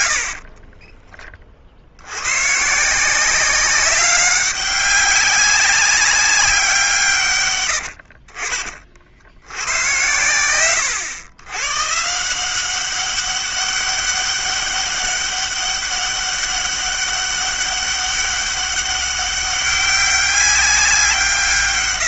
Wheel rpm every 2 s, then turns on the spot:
20, 160, 190, 160, 50, 110, 190, 200, 200, 200, 180.
0-2